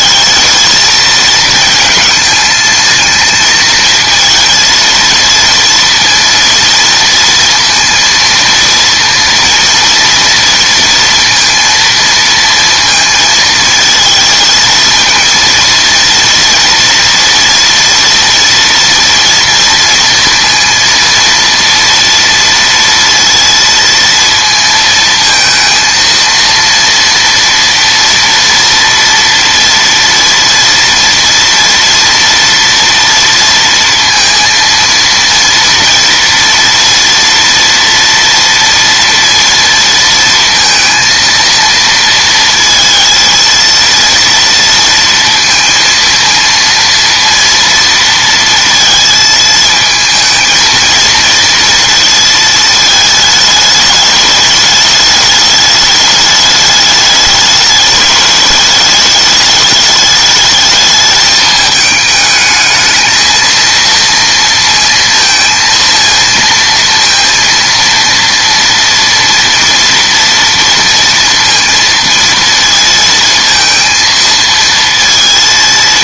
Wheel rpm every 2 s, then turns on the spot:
220, 220, 230, 230, 230, 230, 230, 220, 230, 230, 230, 230, 230, 230, 240, 230, 230, 230, 230, 230, 230, 230, 230, 230, 230, 220, 220, 210, 210, 210, 210, 220, 230, 230, 230, 230, 230, 230.
none